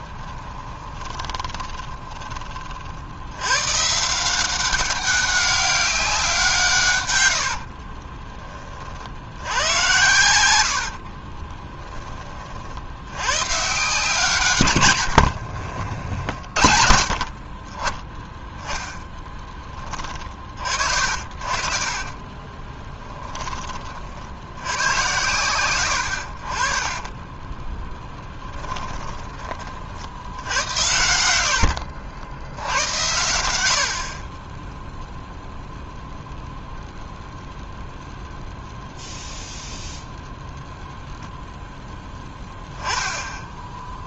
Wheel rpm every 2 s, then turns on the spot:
20, 60, 190, 120, 40, 60, 80, 110, 50, 10, 50, 10, 100, 20, 10, 90, 90, 10, 0, 0, 0, 10.
0-2 10-12 14-16 22-24 26-32